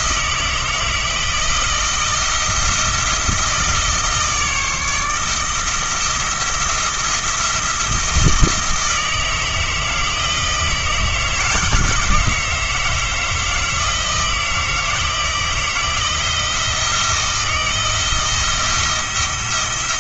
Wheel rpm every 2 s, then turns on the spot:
160, 170, 160, 170, 160, 160, 160, 160, 170, 170.
none